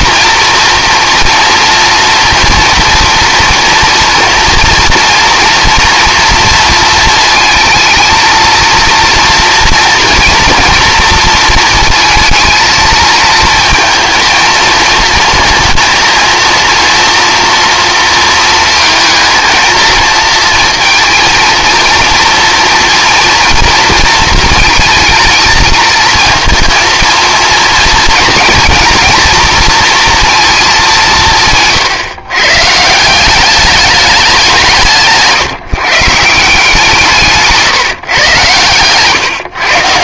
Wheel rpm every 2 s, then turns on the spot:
230, 230, 230, 230, 230, 230, 230, 230, 230, 230, 230, 230, 230, 230, 230, 210, 150, 170, 150, 120.
38-40